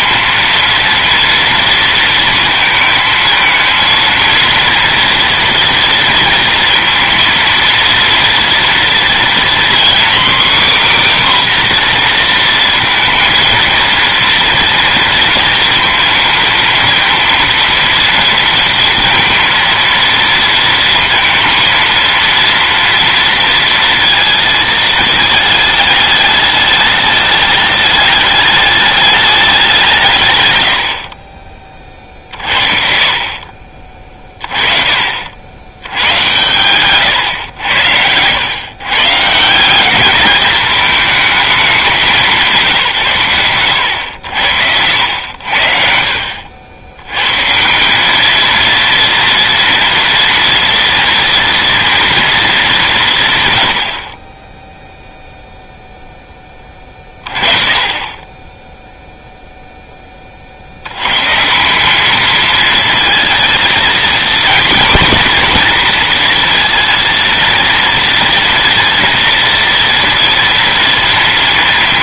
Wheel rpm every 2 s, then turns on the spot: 230, 230, 230, 230, 230, 270, 230, 230, 220, 230, 230, 230, 230, 210, 210, 90, 50, 40, 110, 120, 210, 150, 80, 70, 230, 240, 210, 10, 20, 10, 60, 220, 240, 230, 230, 230.
none